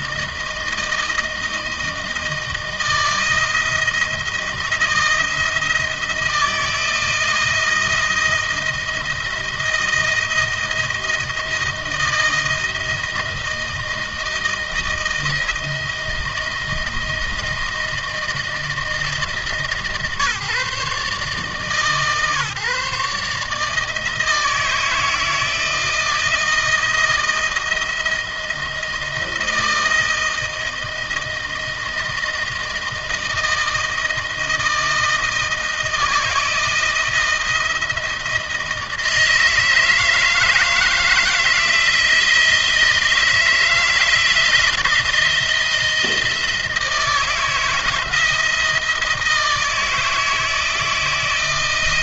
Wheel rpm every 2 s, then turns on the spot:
160, 160, 160, 170, 160, 160, 160, 160, 160, 150, 140, 140, 160, 170, 160, 160, 160, 160, 160, 160, 160, 160, 170, 160, 160, 160.
none